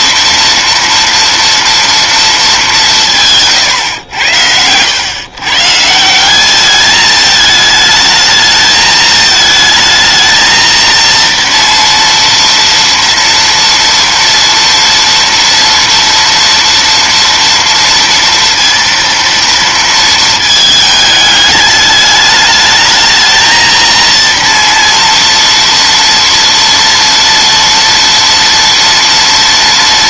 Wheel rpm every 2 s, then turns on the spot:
230, 200, 90, 200, 220, 230, 230, 230, 230, 230, 220, 210, 230, 230, 230.
none